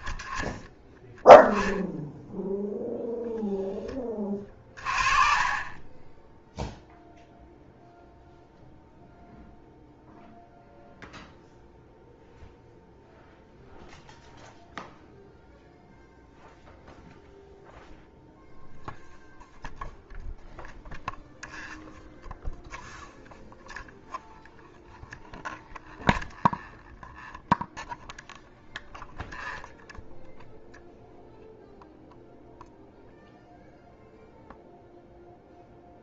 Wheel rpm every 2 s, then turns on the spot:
10, 0, 30, 0, 0, 0, 0, 0, 0, 0, 0, 0, 0, 0, 0, 0, 0, 0.
4-6